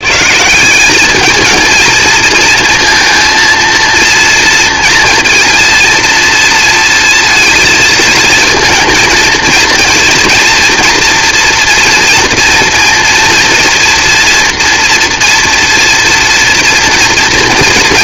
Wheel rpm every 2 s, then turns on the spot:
190, 230, 230, 230, 220, 240, 230, 230, 230.
none